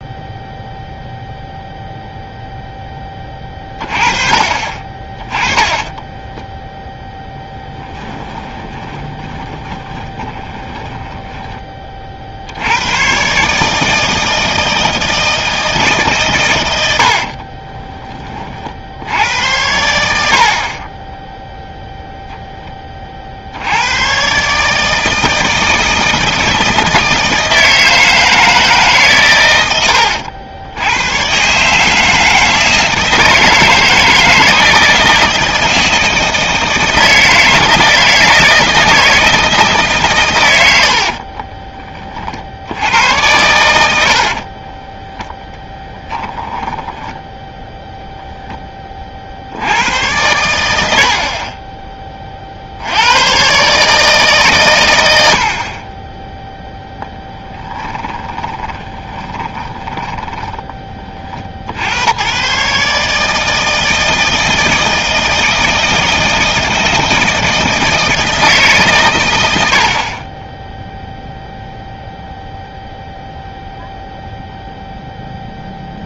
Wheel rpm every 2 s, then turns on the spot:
0, 20, 30, 0, 20, 20, 100, 160, 90, 60, 40, 20, 150, 160, 150, 90, 160, 160, 160, 160, 80, 80, 20, 10, 10, 80, 70, 130, 0, 20, 20, 140, 160, 160, 140, 0, 0, 0.
8-12 40-42 44-48 58-60